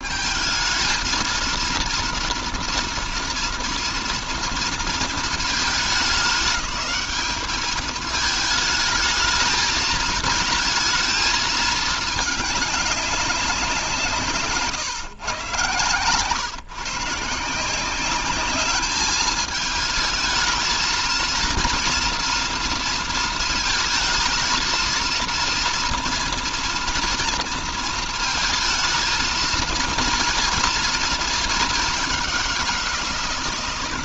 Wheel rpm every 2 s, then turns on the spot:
220, 230, 220, 210, 220, 220, 200, 120, 140, 210, 220, 230, 230, 230, 230, 230, 170.
none